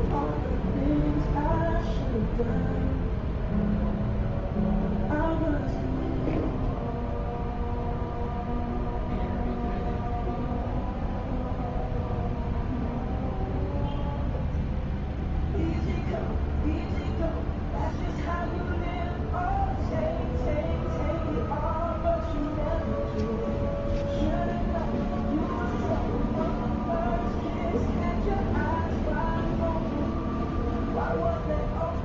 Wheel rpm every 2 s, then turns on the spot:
0, 0, 0, 0, 0, 0, 0, 0, 0, 0, 0, 0, 0, 0, 0, 0.
none